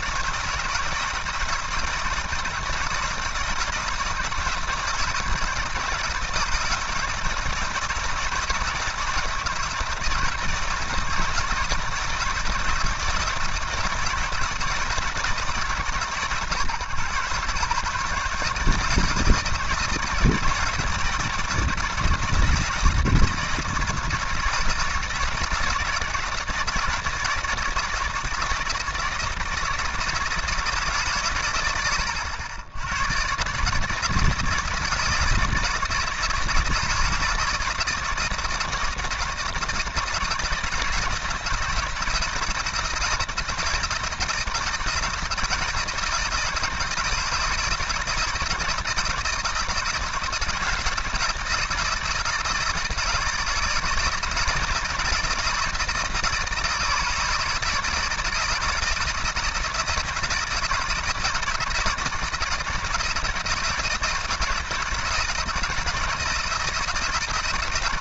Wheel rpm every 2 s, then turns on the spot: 160, 160, 160, 160, 170, 160, 160, 160, 130, 150, 160, 160, 160, 160, 160, 150, 90, 160, 170, 160, 160, 170, 160, 170, 160, 160, 160, 160, 160, 160, 160, 160, 160, 160.
none